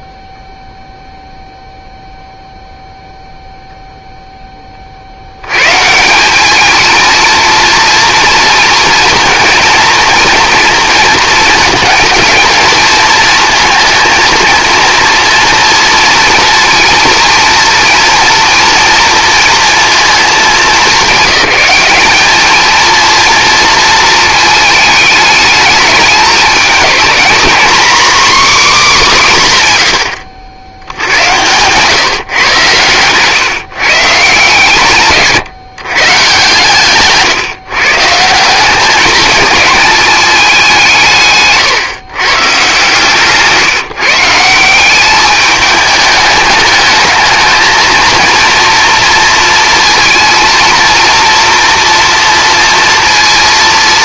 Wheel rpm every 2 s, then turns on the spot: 0, 0, 20, 210, 230, 230, 230, 230, 230, 230, 200, 220, 220, 220, 270, 80, 130, 150, 140, 180, 190, 140, 180, 220, 240, 230, 230.
30-32